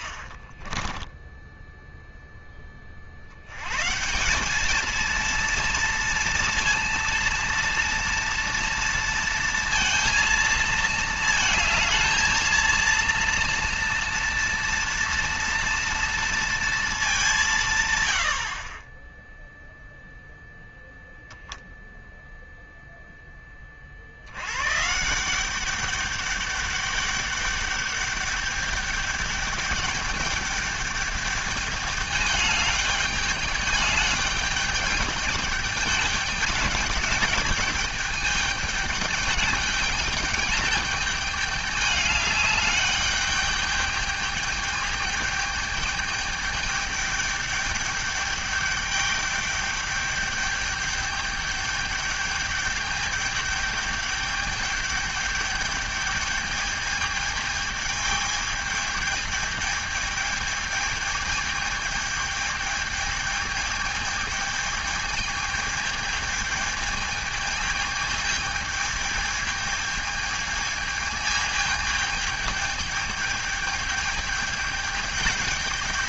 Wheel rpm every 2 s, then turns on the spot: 30, 30, 210, 230, 230, 220, 230, 230, 230, 50, 0, 0, 150, 200, 200, 210, 200, 200, 210, 210, 210, 200, 210, 210, 210, 200, 210, 210, 210, 210, 210, 220, 210, 220, 220, 220, 210, 210.
0-2